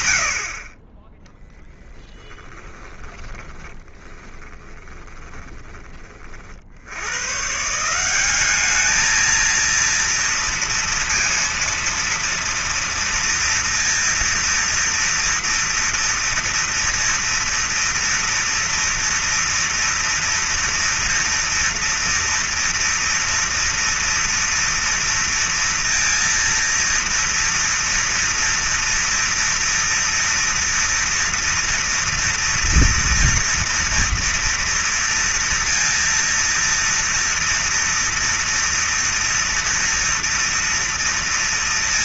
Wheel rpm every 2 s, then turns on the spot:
110, 10, 20, 20, 170, 230, 230, 230, 230, 230, 230, 230, 230, 230, 230, 230, 240, 230, 230, 230, 230.
2-6